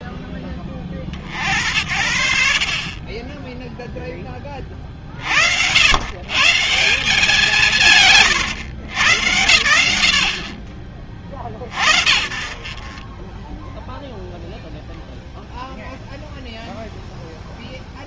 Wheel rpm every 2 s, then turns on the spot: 40, 40, 40, 180, 130, 70, 40, 0, 0.
none